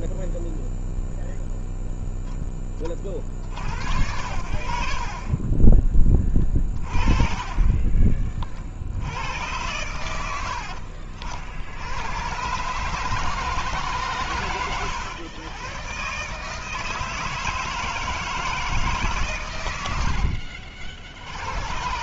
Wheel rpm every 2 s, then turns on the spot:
0, 10, 70, 20, 40, 80, 120, 130, 140, 160, 70.
20-22